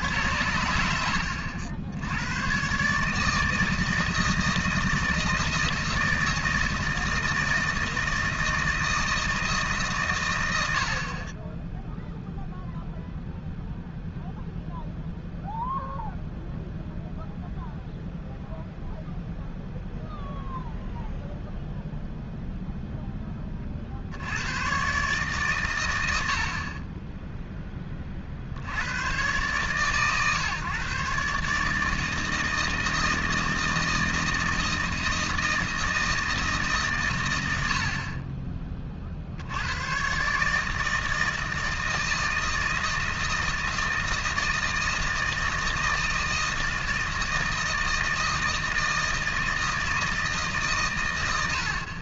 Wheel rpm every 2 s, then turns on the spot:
80, 100, 160, 160, 160, 140, 0, 0, 0, 0, 0, 0, 70, 100, 30, 140, 160, 170, 160, 60, 110, 160, 160, 160, 160, 160.
none